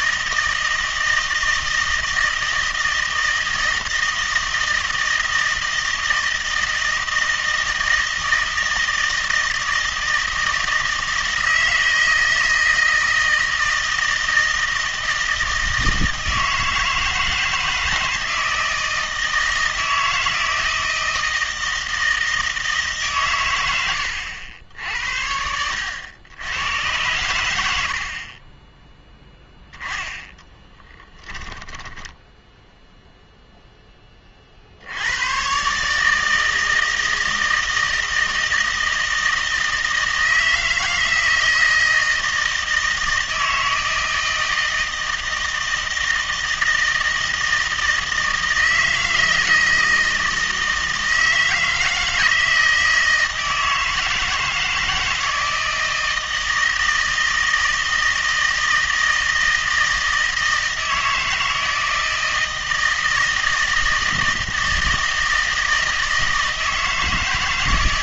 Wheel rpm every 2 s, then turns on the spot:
160, 160, 160, 160, 160, 160, 160, 160, 160, 160, 160, 150, 80, 100, 10, 10, 0, 70, 160, 160, 160, 160, 160, 160, 160, 160, 160, 160, 160, 160, 160, 160, 160, 160.
30-32